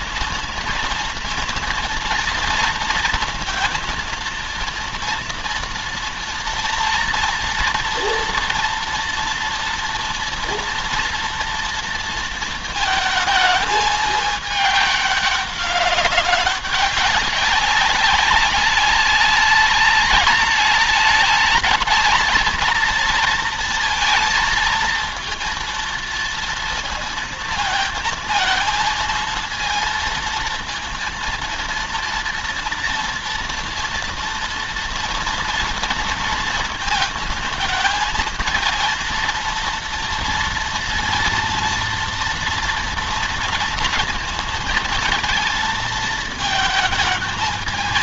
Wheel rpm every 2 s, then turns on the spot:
230, 230, 230, 230, 230, 230, 220, 210, 200, 210, 210, 230, 230, 230, 230, 230, 230, 240, 220, 230, 230, 230, 230, 220.
none